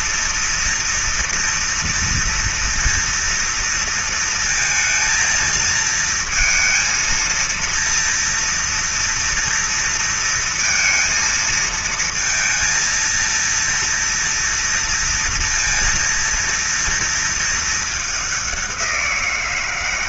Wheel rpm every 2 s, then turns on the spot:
240, 240, 230, 230, 230, 230, 230, 230, 230, 180.
none